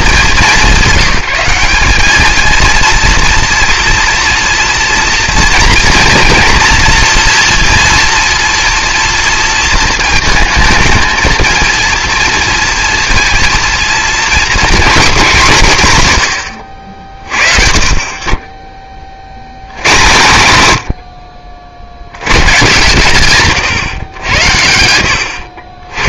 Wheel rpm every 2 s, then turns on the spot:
190, 220, 230, 230, 230, 220, 230, 210, 70, 10, 40, 140, 90.
none